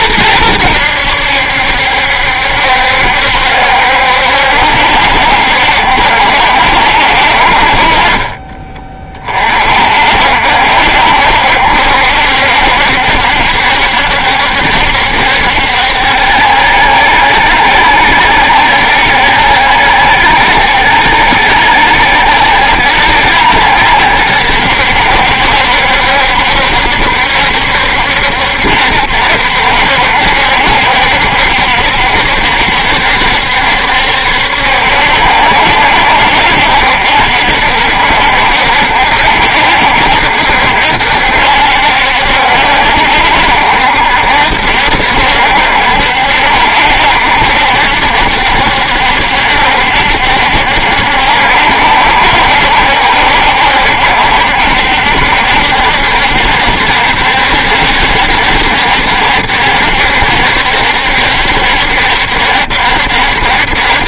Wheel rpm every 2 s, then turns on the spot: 90, 70, 70, 60, 30, 70, 70, 70, 70, 70, 70, 70, 70, 70, 70, 70, 70, 70, 70, 70, 70, 70, 70, 70, 70, 70, 70, 70, 70, 70, 70, 70.
none